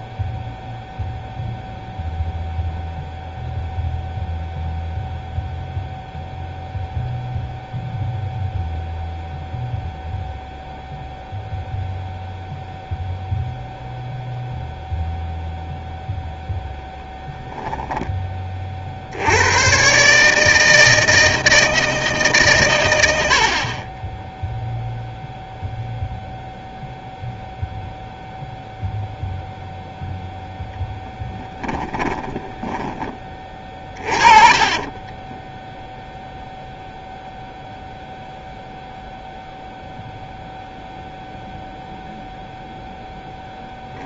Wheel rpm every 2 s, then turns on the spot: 0, 0, 0, 0, 0, 0, 0, 0, 0, 40, 160, 120, 0, 0, 0, 0, 10, 30, 0, 0, 0, 10.
32-36